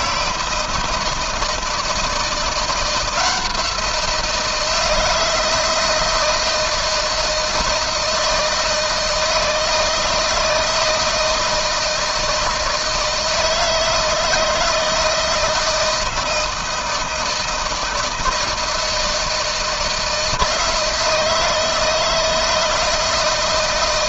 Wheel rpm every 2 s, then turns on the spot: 160, 170, 160, 160, 160, 160, 160, 160, 170, 160, 160, 160.
none